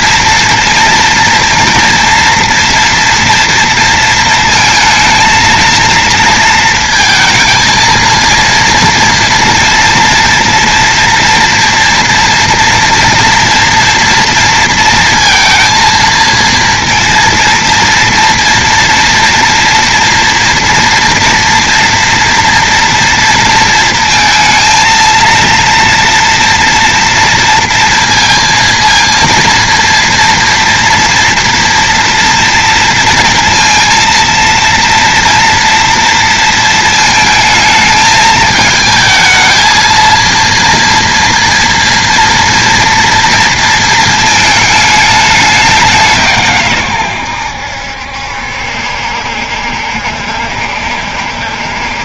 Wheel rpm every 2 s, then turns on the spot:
230, 230, 220, 220, 230, 230, 230, 230, 230, 230, 230, 230, 230, 240, 230, 230, 230, 230, 220, 220, 230, 230, 210, 110, 70, 70.
none